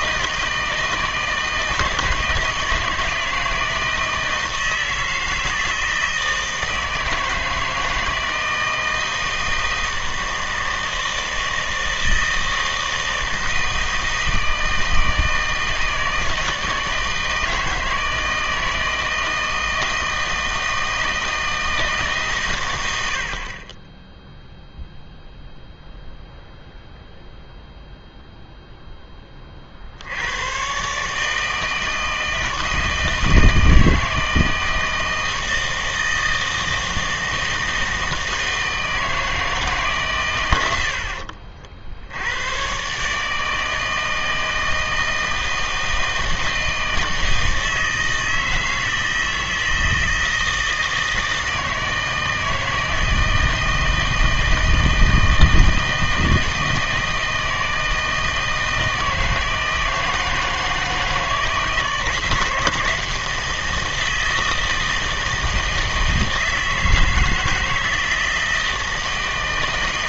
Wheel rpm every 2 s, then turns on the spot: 160, 160, 160, 160, 160, 160, 160, 160, 160, 160, 160, 110, 0, 0, 0, 120, 160, 160, 160, 160, 80, 120, 160, 160, 160, 160, 160, 160, 160, 160, 160, 160, 160, 160, 160.
none